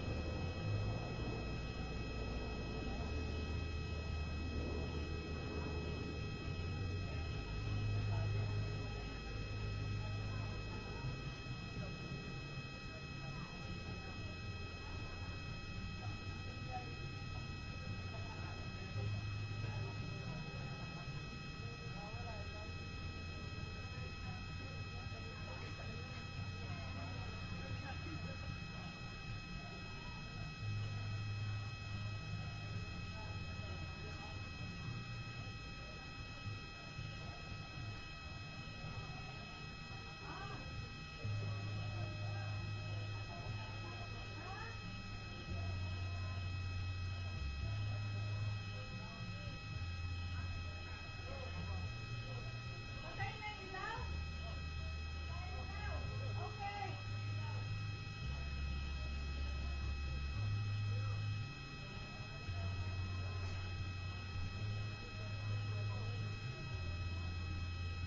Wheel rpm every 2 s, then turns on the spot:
0, 0, 0, 0, 0, 0, 0, 0, 0, 0, 0, 0, 0, 0, 0, 0, 0, 0, 0, 0, 0, 0, 0, 0, 0, 0, 0, 0, 0, 0, 0, 0, 0, 0.
none